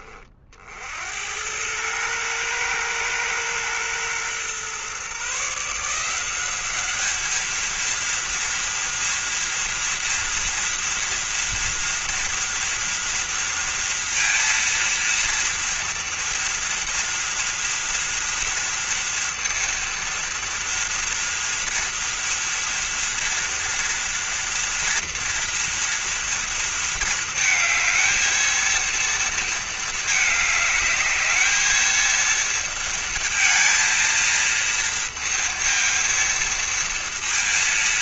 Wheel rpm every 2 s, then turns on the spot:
70, 120, 130, 210, 230, 230, 230, 230, 230, 230, 230, 230, 230, 220, 230, 210, 230, 230, 230.
none